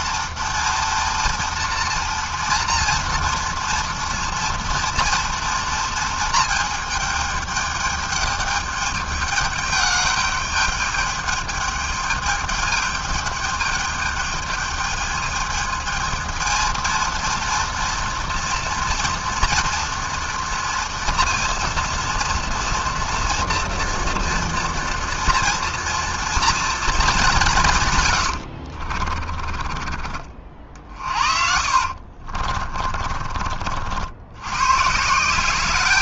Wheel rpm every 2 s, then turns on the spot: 230, 240, 230, 210, 210, 210, 210, 220, 230, 230, 230, 230, 230, 180, 30, 50, 50, 190.
28-32